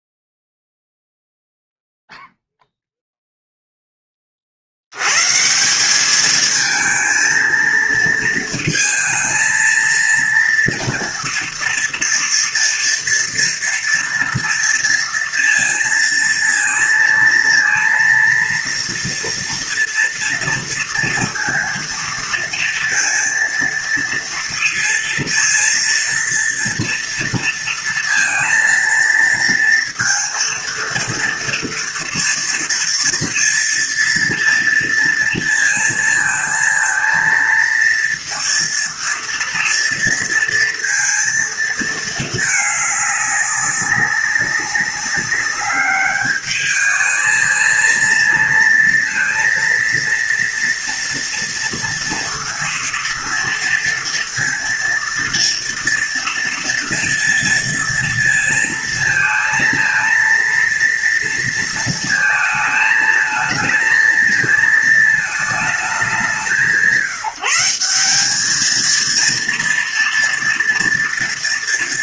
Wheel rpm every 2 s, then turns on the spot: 0, 0, 60, 220, 230, 230, 230, 230, 230, 230, 230, 230, 230, 230, 230, 230, 230, 230, 220, 230, 230, 210, 200, 210, 230, 230, 230, 230, 230, 230, 230, 230, 220, 170, 220, 230.
none